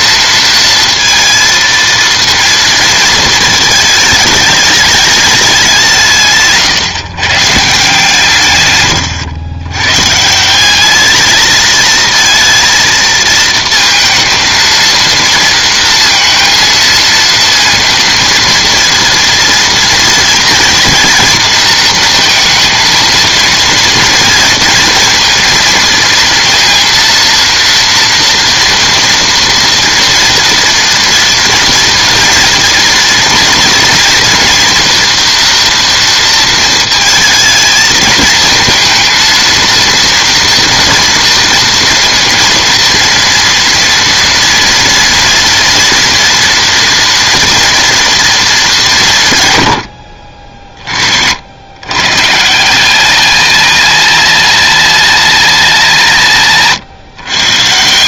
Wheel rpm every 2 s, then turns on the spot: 230, 230, 210, 140, 130, 190, 230, 220, 230, 230, 230, 230, 230, 230, 230, 230, 240, 230, 230, 220, 240, 230, 230, 230, 200, 50, 180, 230, 150.
none